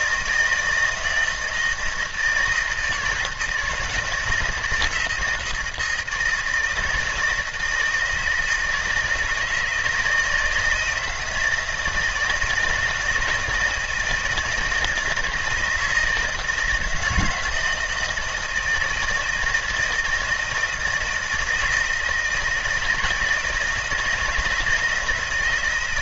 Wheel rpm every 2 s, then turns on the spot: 160, 160, 160, 160, 160, 170, 160, 160, 160, 160, 160, 160, 160.
none